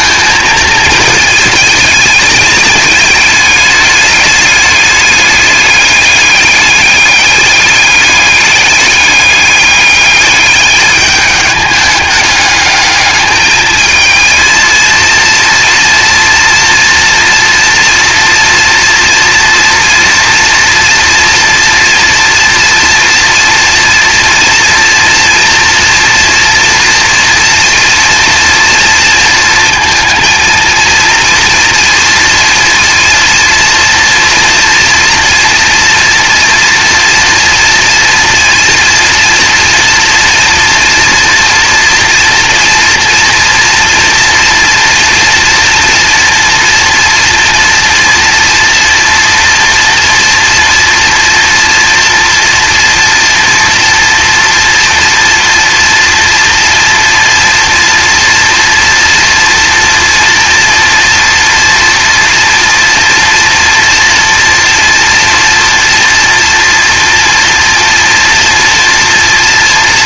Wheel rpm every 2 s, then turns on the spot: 220, 210, 210, 200, 200, 210, 210, 230, 230, 230, 230, 230, 240, 230, 230, 230, 230, 240, 230, 230, 230, 240, 230, 230, 230, 230, 230, 230, 240, 230, 240, 230, 230, 230, 230.
none